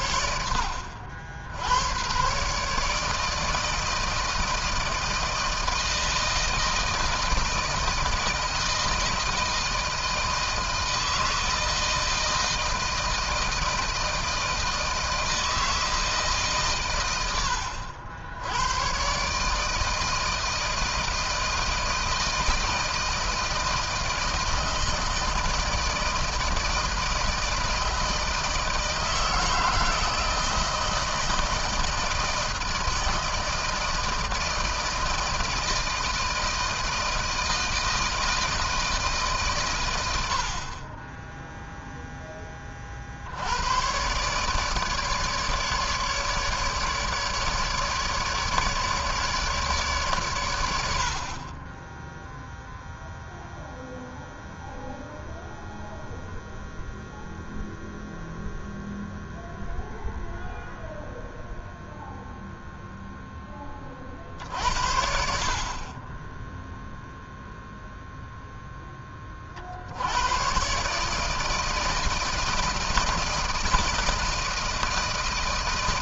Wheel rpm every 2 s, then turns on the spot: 80, 140, 160, 160, 160, 160, 160, 160, 140, 100, 160, 160, 160, 160, 160, 160, 160, 160, 160, 160, 60, 20, 150, 150, 150, 100, 0, 0, 0, 0, 0, 0, 50, 10, 0, 120, 160, 160.
none